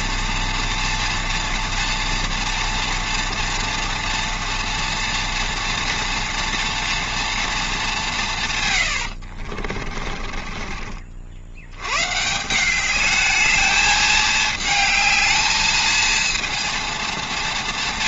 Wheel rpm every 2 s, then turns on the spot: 230, 230, 230, 230, 140, 40, 200, 220, 230.
10-12